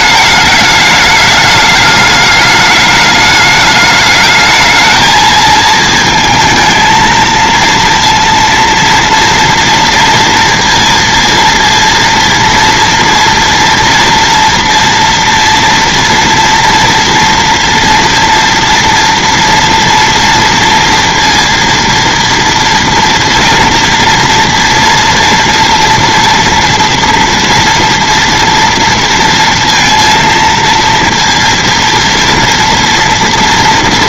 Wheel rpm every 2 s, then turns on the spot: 210, 210, 220, 220, 230, 230, 230, 230, 230, 230, 230, 230, 230, 230, 230, 230, 230.
none